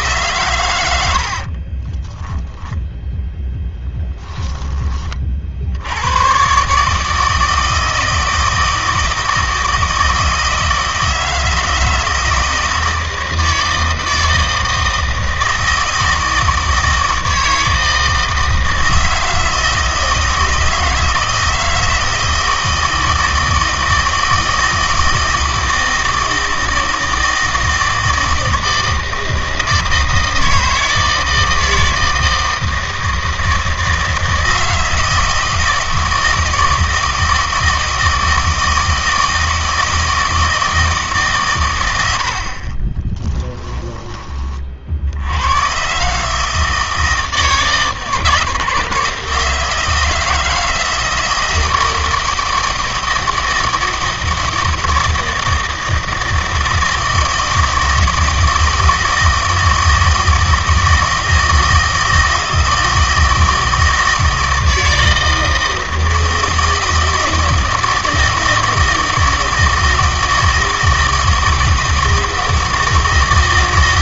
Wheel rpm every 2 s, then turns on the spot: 110, 10, 20, 140, 160, 160, 160, 160, 160, 160, 160, 160, 160, 160, 160, 160, 160, 160, 160, 160, 160, 40, 50, 160, 160, 160, 160, 160, 160, 160, 160, 160, 160, 160, 160, 160, 160.
42-44